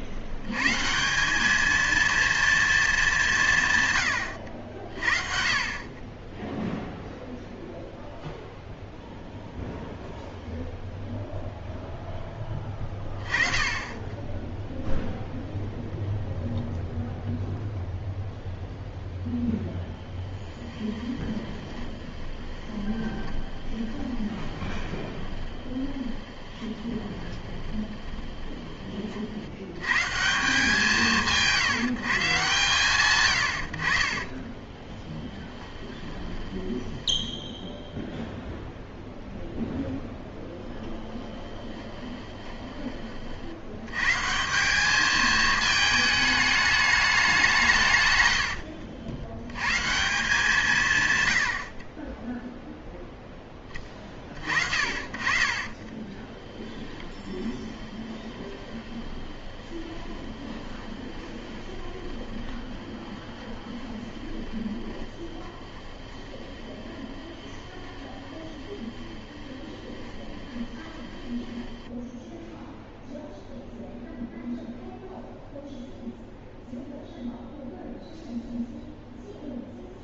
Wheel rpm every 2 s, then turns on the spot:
150, 220, 60, 0, 0, 0, 20, 0, 0, 0, 10, 20, 20, 20, 30, 180, 140, 20, 10, 0, 10, 30, 200, 210, 80, 160, 0, 50, 20, 20, 20, 20, 20, 20, 20, 20, 0, 0, 0, 0.
20-28 34-38 40-42 48-50 56-72